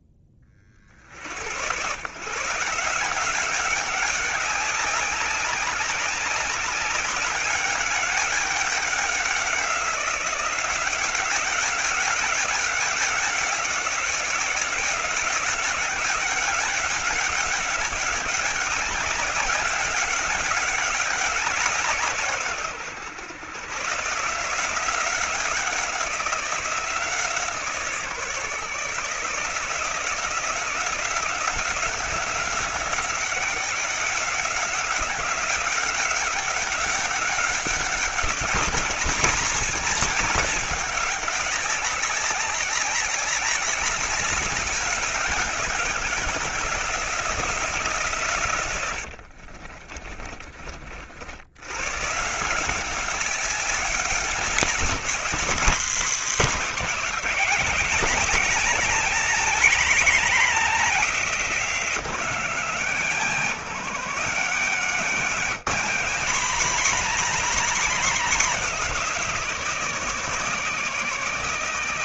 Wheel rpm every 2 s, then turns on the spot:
60, 170, 190, 200, 190, 180, 190, 180, 200, 190, 190, 120, 180, 170, 150, 170, 180, 190, 200, 220, 200, 200, 190, 170, 80, 60, 190, 200, 230, 250, 230, 180, 210, 240, 250, 250.
48-50